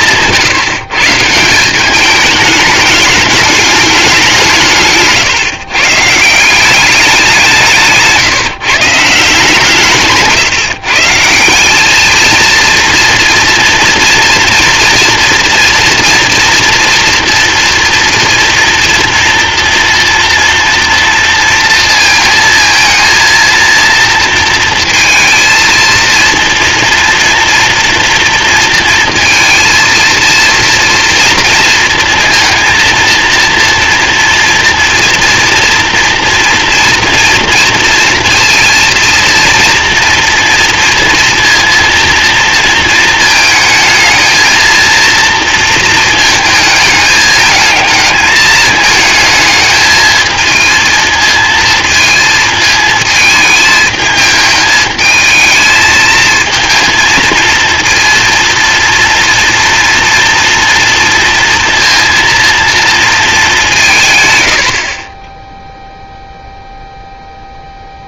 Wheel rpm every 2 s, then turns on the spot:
150, 210, 160, 190, 160, 150, 230, 230, 230, 240, 230, 230, 230, 230, 230, 230, 230, 230, 230, 230, 230, 230, 220, 220, 220, 230, 230, 220, 230, 230, 230, 230, 90, 0.
none